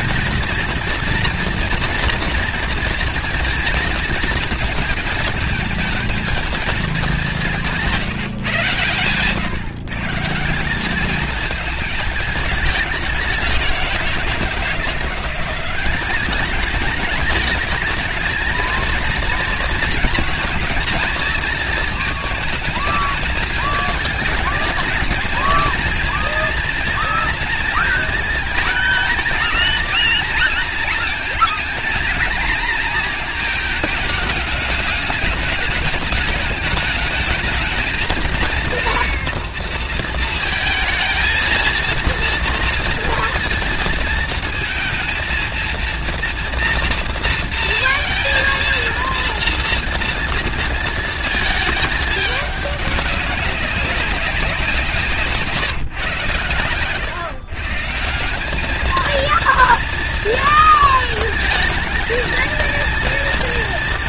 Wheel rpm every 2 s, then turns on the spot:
230, 230, 220, 220, 140, 190, 200, 170, 210, 220, 220, 220, 220, 230, 220, 230, 230, 210, 210, 230, 230, 230, 230, 230, 230, 230, 200, 180, 110, 200, 230, 230.
none